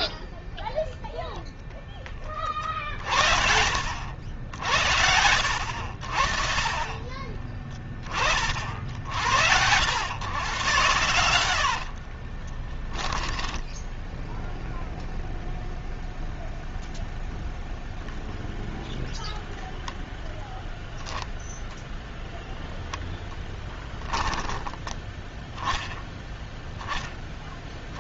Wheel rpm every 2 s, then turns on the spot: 0, 30, 70, 30, 70, 120, 10, 0, 0, 0, 0, 0, 10, 10.
none